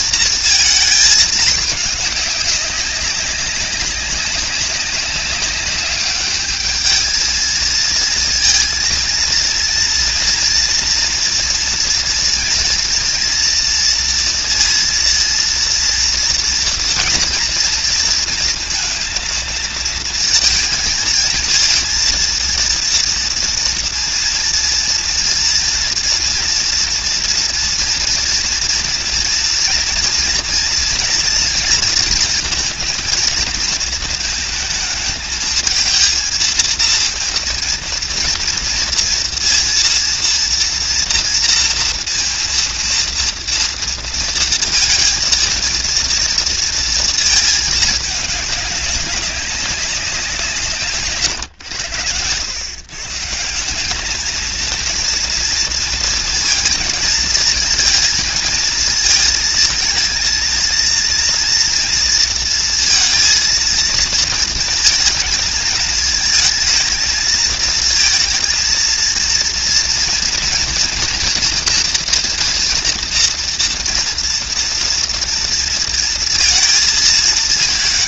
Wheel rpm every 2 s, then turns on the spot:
230, 210, 200, 210, 220, 230, 230, 230, 230, 230, 230, 230, 230, 240, 230, 230, 230, 220, 230, 230, 230, 230, 230, 230, 210, 180, 100, 200, 230, 230, 220, 230, 230, 220, 230, 230, 230, 240, 230.
none